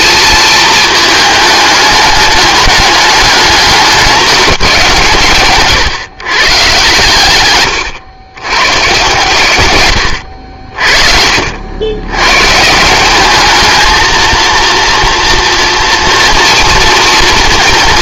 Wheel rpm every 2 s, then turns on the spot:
220, 210, 180, 130, 130, 60, 150, 230, 230.
10-12